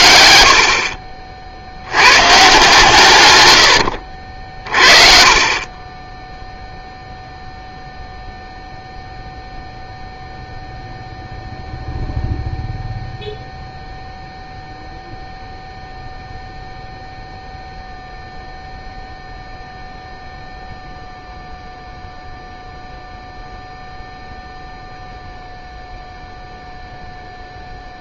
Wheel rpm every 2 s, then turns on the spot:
60, 150, 50, 0, 0, 0, 0, 0, 0, 0, 0, 0, 0, 0.
0-2